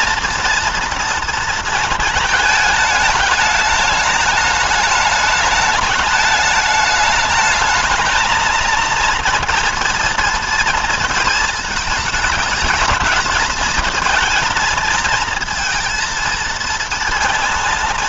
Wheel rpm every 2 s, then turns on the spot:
240, 220, 210, 210, 220, 230, 210, 230, 230.
none